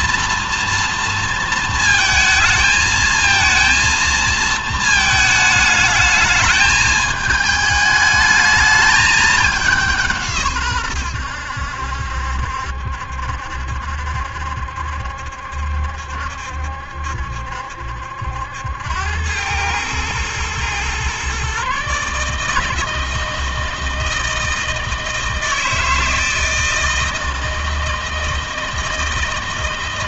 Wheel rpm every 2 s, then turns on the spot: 230, 220, 220, 210, 210, 120, 70, 70, 70, 90, 120, 160, 160, 160, 160.
none